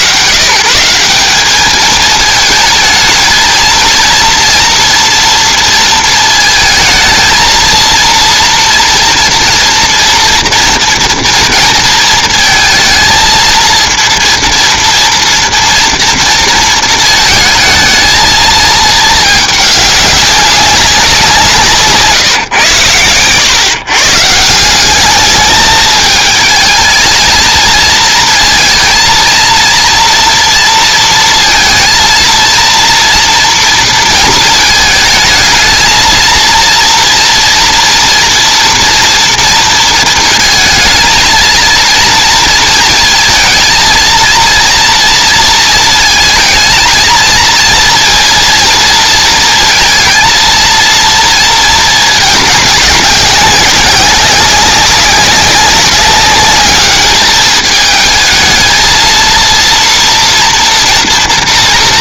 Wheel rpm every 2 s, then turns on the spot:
180, 220, 230, 220, 230, 230, 230, 230, 230, 220, 180, 110, 200, 220, 230, 230, 230, 220, 230, 230, 230, 230, 230, 230, 230, 230, 200, 190, 210, 230, 230.
none